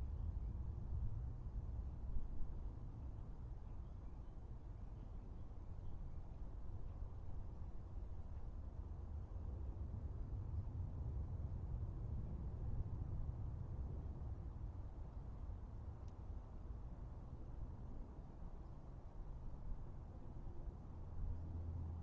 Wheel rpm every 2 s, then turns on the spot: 0, 0, 0, 0, 0, 0, 0, 0, 0, 0, 0.
none